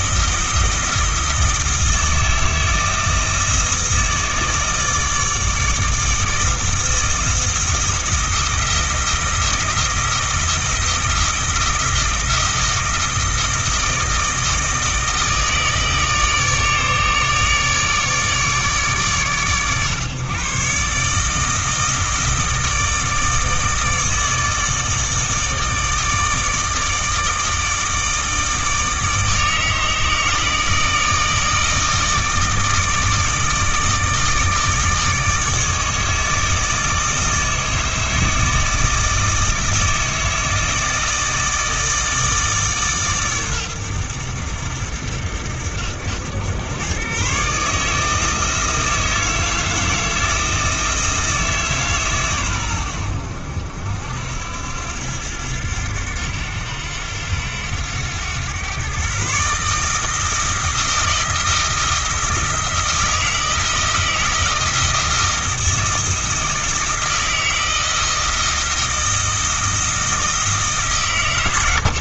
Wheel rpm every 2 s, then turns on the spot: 160, 160, 160, 160, 170, 160, 160, 160, 150, 150, 140, 160, 160, 160, 160, 160, 160, 150, 160, 160, 160, 150, 80, 110, 160, 160, 110, 80, 90, 120, 170, 160, 160, 160, 160, 150.
none